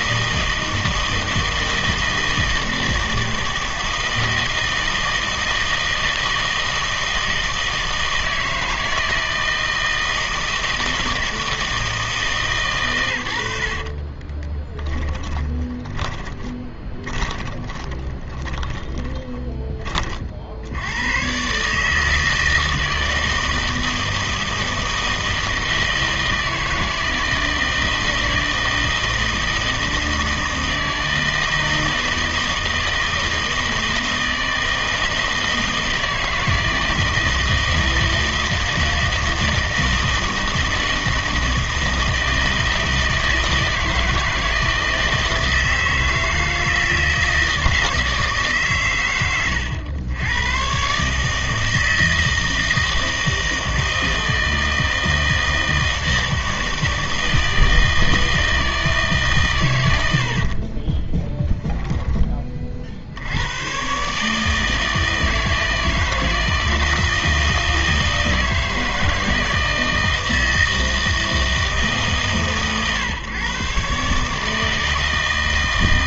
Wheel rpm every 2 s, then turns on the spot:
160, 160, 160, 160, 160, 160, 120, 10, 20, 10, 80, 160, 160, 160, 160, 160, 160, 160, 160, 160, 160, 160, 160, 160, 130, 120, 160, 160, 160, 160, 40, 40, 160, 160, 160, 160, 130, 160.
14-20 60-62